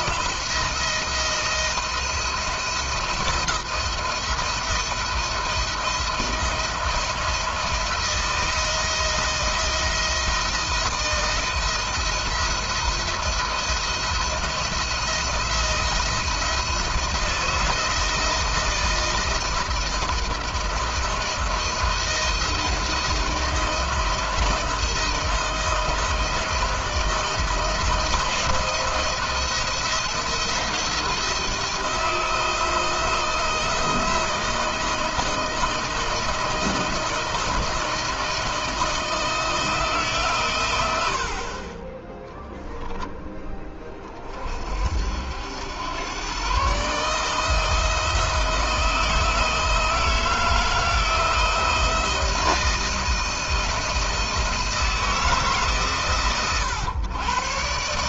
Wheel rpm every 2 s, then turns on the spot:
160, 170, 170, 170, 160, 170, 170, 170, 170, 160, 170, 160, 160, 170, 170, 170, 170, 170, 160, 160, 120, 10, 40, 130, 160, 160, 160, 160, 120.
none